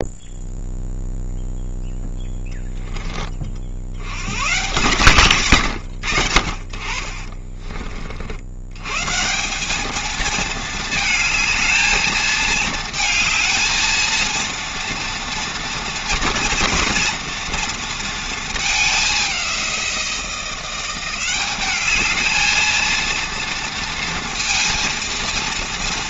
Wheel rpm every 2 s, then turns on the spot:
0, 10, 140, 40, 110, 220, 220, 230, 230, 220, 180, 220, 230.
none